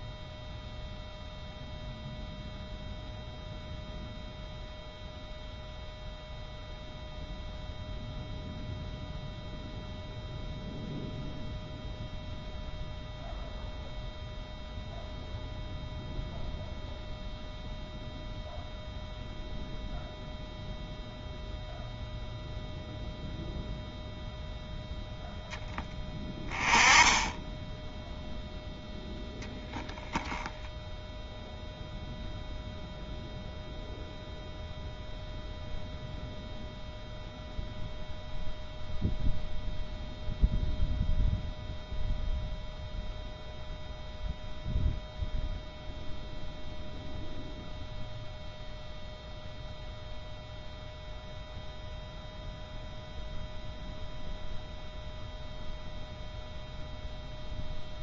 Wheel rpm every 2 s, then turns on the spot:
0, 0, 0, 0, 0, 0, 0, 0, 0, 0, 0, 0, 0, 10, 0, 0, 0, 0, 0, 0, 0, 0, 0, 0, 0, 0, 0, 0, 0.
none